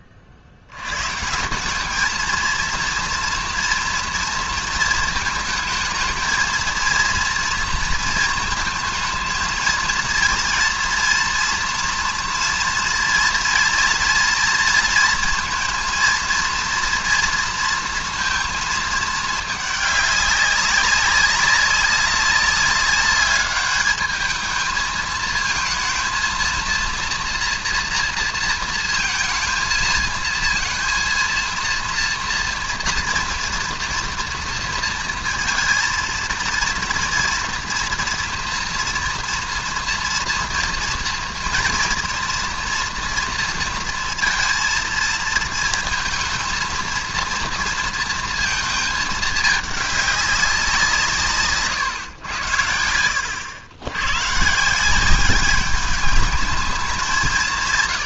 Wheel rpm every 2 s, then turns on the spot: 70, 230, 220, 230, 230, 230, 230, 230, 230, 220, 200, 200, 220, 230, 230, 230, 230, 230, 230, 230, 230, 230, 230, 230, 220, 180, 80, 160, 200.
none